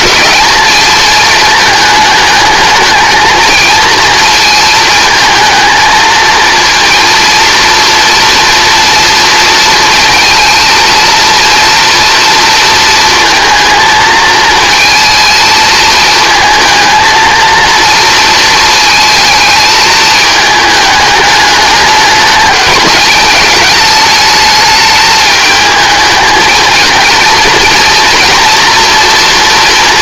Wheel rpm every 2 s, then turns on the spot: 220, 220, 230, 230, 240, 230, 230, 220, 220, 230, 210, 210, 210, 220, 240.
none